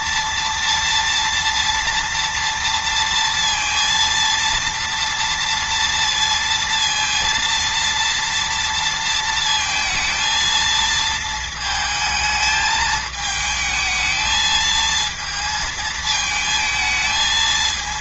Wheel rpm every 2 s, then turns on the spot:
230, 230, 230, 230, 230, 230, 220, 220, 220.
none